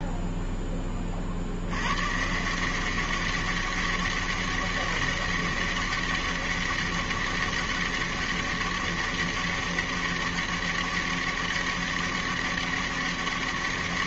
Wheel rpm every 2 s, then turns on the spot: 20, 180, 200, 200, 200, 200, 200.
none